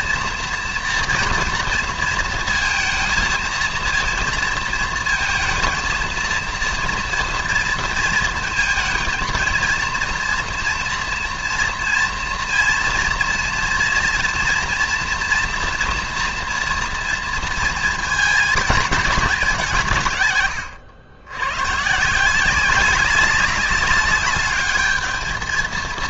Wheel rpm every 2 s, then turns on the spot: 240, 230, 230, 230, 230, 230, 230, 230, 230, 220, 110, 190, 210.
none